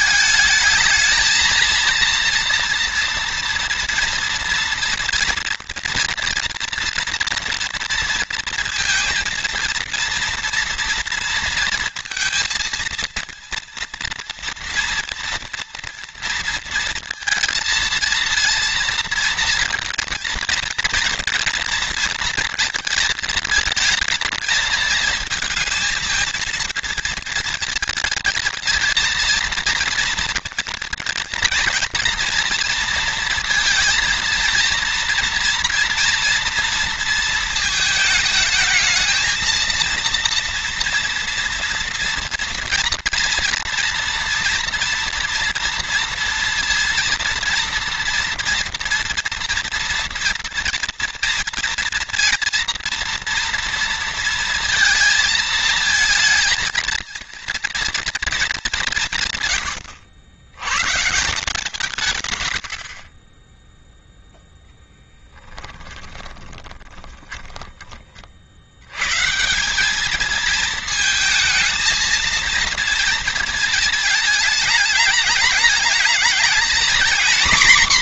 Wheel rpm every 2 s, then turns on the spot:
220, 230, 230, 230, 230, 230, 230, 230, 230, 230, 230, 220, 220, 230, 230, 230, 230, 230, 230, 220, 230, 230, 230, 230, 230, 230, 230, 230, 230, 170, 140, 50, 10, 20, 110, 220, 230, 210, 230.
64-68